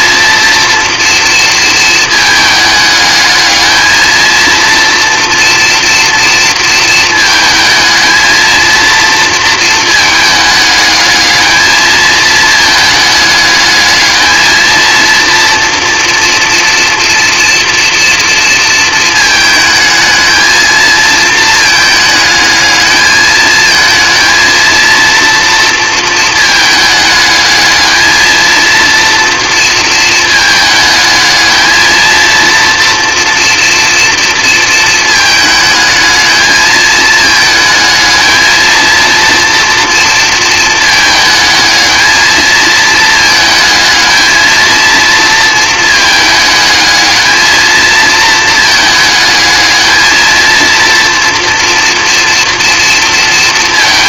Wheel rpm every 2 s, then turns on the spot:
230, 210, 230, 230, 230, 220, 220, 230, 230, 220, 220, 220, 230, 220, 230, 220, 230, 220, 220, 230, 220, 220, 220, 220, 220, 230, 230.
none